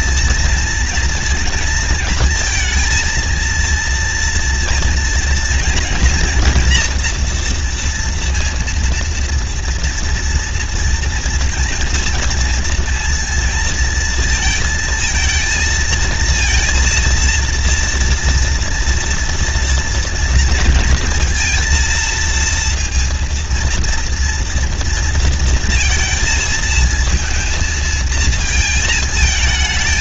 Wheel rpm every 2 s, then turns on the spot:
230, 230, 230, 230, 230, 230, 230, 230, 230, 230, 230, 230, 230, 220, 220.
none